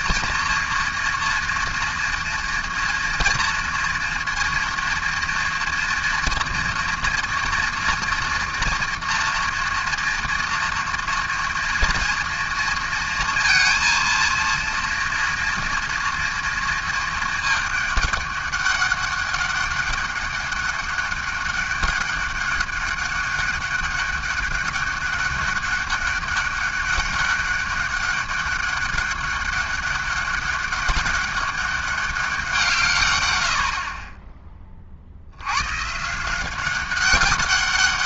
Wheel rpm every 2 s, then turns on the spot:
240, 240, 230, 230, 230, 230, 230, 230, 230, 200, 200, 200, 200, 200, 200, 200, 160, 30, 190.
none